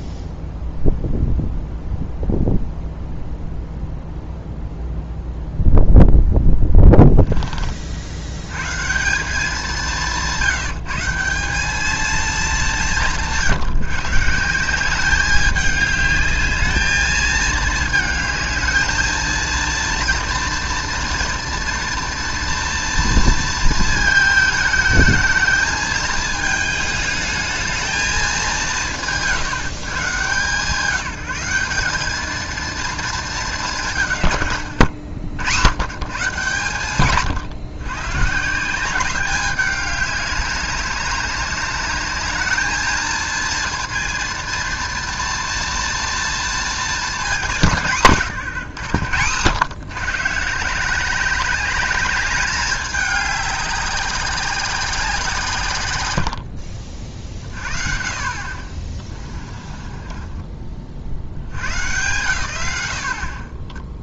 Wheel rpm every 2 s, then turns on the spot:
0, 0, 0, 10, 130, 170, 200, 180, 210, 220, 230, 230, 220, 220, 140, 150, 230, 110, 130, 170, 200, 220, 230, 230, 140, 170, 200, 190, 60, 30, 40, 100.
58-60